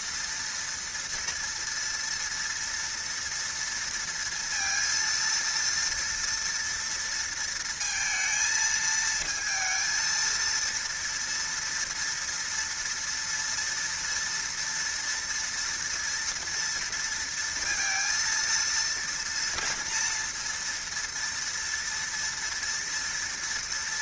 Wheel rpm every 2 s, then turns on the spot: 230, 230, 230, 230, 220, 230, 230, 230, 230, 230, 230, 230.
none